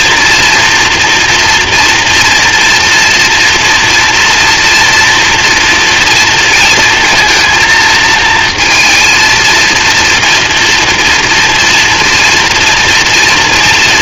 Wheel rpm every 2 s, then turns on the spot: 240, 240, 230, 230, 230, 230, 230.
none